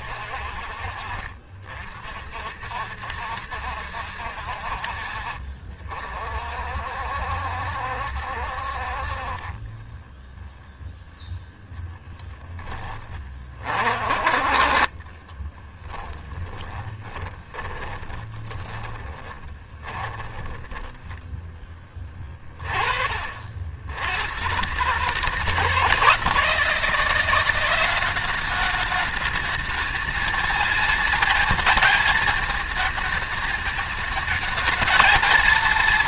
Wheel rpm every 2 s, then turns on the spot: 50, 60, 60, 60, 60, 0, 30, 30, 20, 30, 30, 40, 130, 160, 200, 220, 220, 220.
0-2 14-22